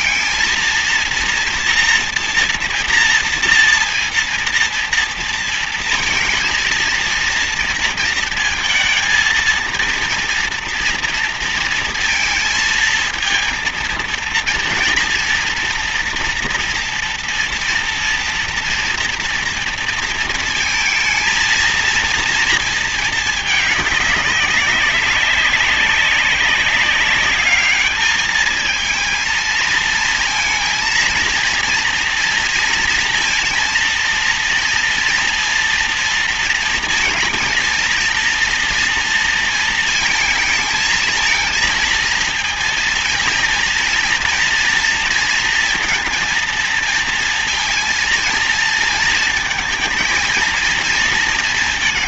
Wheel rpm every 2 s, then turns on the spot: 230, 240, 230, 230, 230, 230, 230, 230, 230, 230, 230, 220, 200, 190, 220, 230, 230, 230, 230, 230, 220, 230, 230, 230, 230, 230.
none